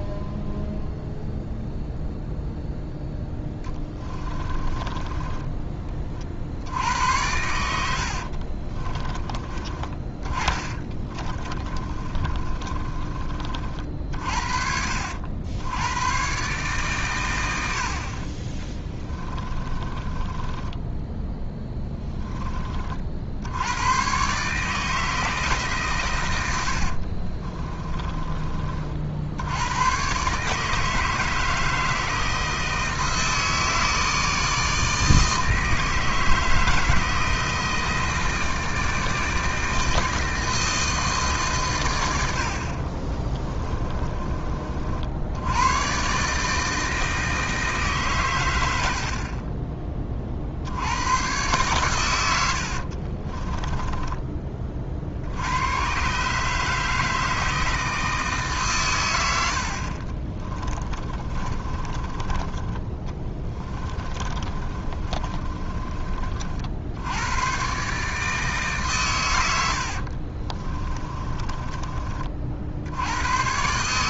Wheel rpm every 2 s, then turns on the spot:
0, 0, 20, 40, 80, 20, 30, 50, 120, 50, 20, 20, 120, 120, 20, 120, 160, 160, 160, 160, 160, 100, 30, 130, 140, 30, 120, 10, 120, 160, 50, 30, 30, 30, 140, 60, 30.
4-6 8-14 20-24 28-30 44-46 54-56 60-66 70-72